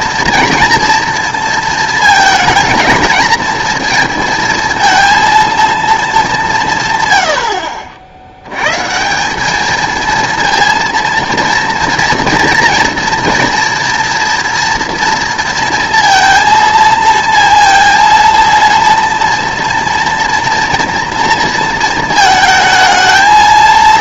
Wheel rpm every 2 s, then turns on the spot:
230, 230, 230, 160, 120, 230, 230, 230, 230, 230, 230, 220.
none